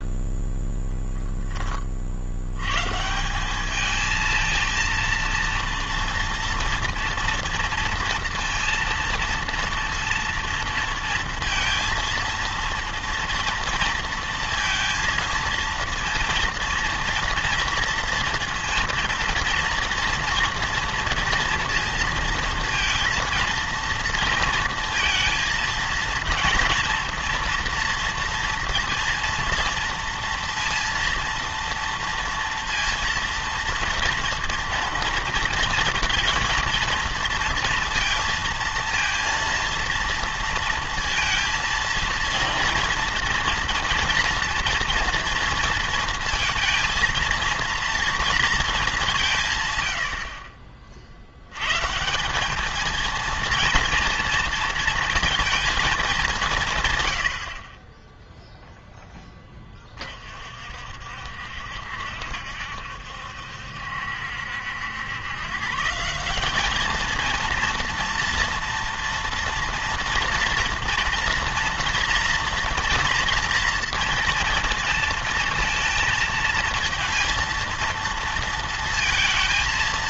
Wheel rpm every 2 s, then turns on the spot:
0, 100, 220, 230, 230, 230, 230, 230, 230, 230, 230, 230, 230, 230, 230, 230, 230, 230, 230, 230, 230, 230, 240, 230, 230, 40, 210, 230, 170, 0, 50, 70, 70, 200, 230, 230, 230, 230, 230, 230.
none